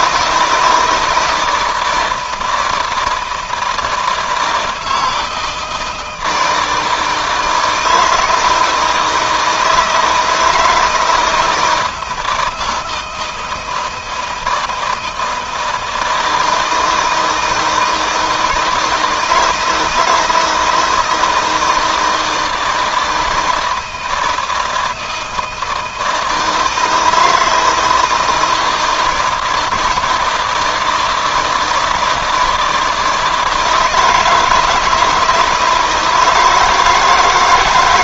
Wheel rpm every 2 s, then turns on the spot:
160, 160, 160, 160, 160, 160, 160, 160, 160, 160, 170, 160, 160, 160, 160, 160, 160, 160, 150.
none